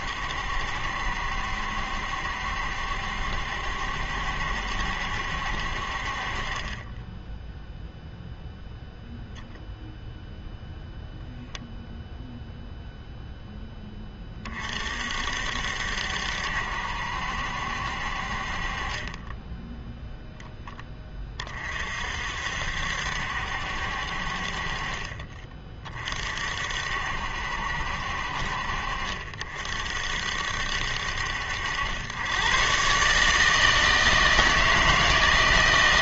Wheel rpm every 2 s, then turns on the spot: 70, 70, 70, 30, 0, 0, 0, 40, 70, 40, 20, 60, 50, 60, 50, 60, 120, 160.
none